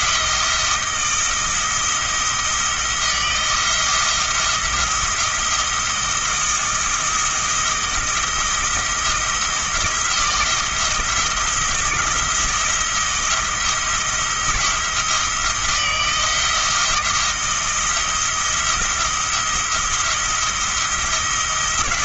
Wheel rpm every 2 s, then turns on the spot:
170, 170, 170, 170, 170, 170, 170, 170, 170, 170, 170.
none